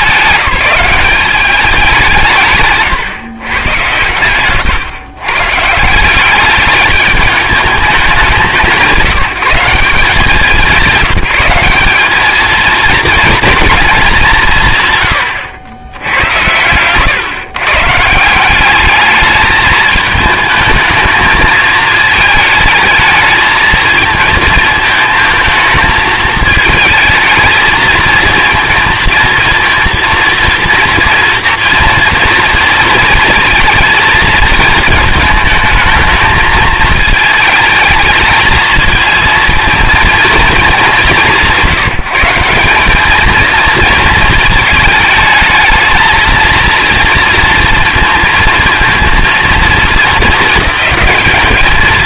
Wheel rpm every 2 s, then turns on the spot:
190, 130, 120, 210, 170, 180, 220, 150, 110, 190, 220, 220, 220, 220, 220, 230, 220, 220, 220, 220, 220, 190, 220, 230, 230, 210.
none